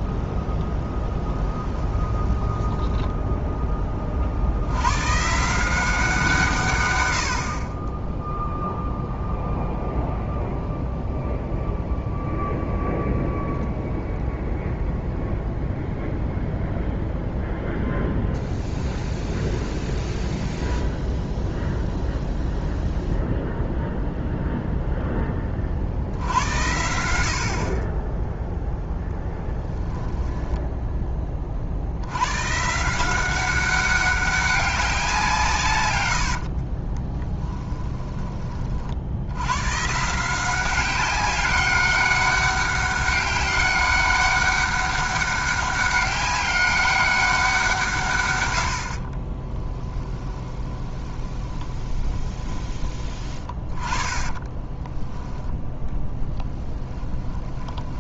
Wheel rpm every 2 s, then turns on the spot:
0, 10, 80, 140, 0, 0, 0, 10, 0, 0, 0, 0, 0, 80, 0, 10, 140, 190, 50, 40, 180, 200, 200, 200, 80, 20, 20, 20, 10.
2-4 36-38 50-52 54-58